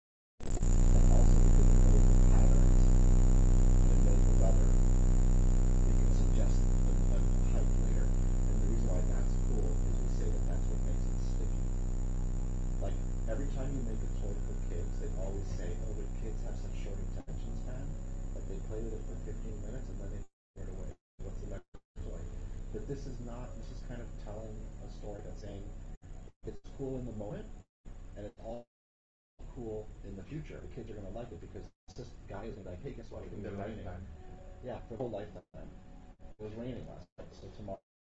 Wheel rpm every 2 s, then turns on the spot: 0, 0, 0, 0, 0, 0, 0, 0, 0, 0, 0, 0, 0, 0, 0, 0, 0, 0, 0.
none